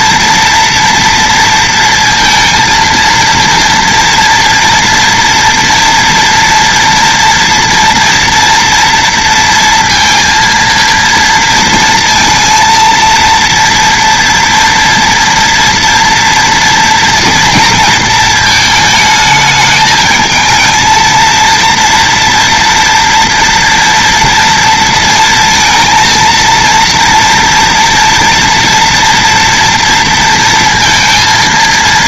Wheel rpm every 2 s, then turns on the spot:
230, 230, 230, 230, 230, 230, 230, 230, 230, 220, 230, 230, 230, 230, 230, 230.
none